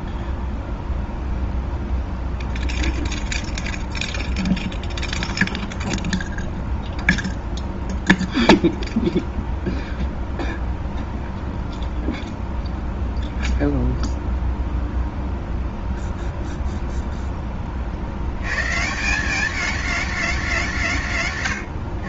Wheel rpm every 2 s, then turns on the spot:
0, 0, 0, 0, 0, 0, 0, 0, 0, 110, 150.
none